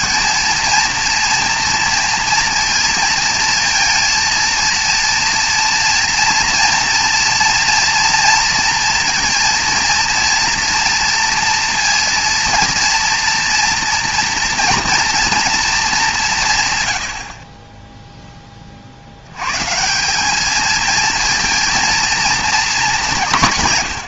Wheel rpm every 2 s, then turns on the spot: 220, 230, 230, 230, 230, 230, 230, 230, 130, 20, 220, 220.
none